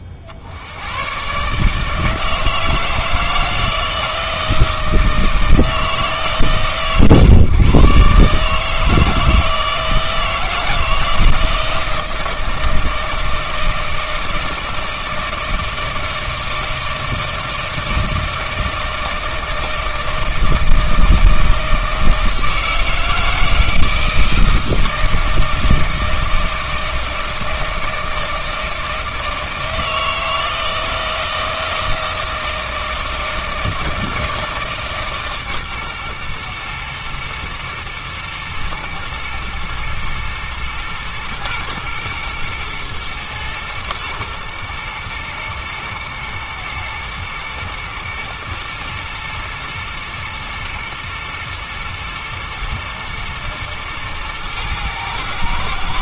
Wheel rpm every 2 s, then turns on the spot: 50, 160, 160, 130, 150, 160, 160, 160, 160, 160, 160, 160, 160, 160, 160, 160, 160, 160, 120, 110, 120, 110, 110, 110, 120, 110, 110, 110.
none